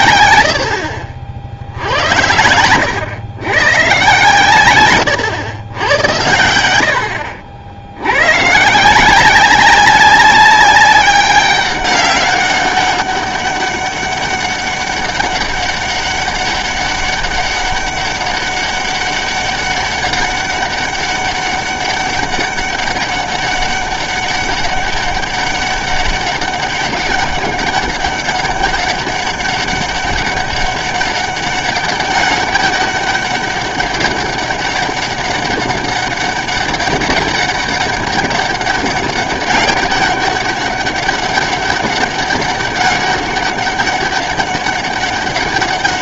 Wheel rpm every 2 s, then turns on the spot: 70, 100, 130, 80, 140, 200, 200, 200, 200, 200, 200, 200, 200, 190, 200, 200, 200, 200, 200, 200, 190, 200, 200.
none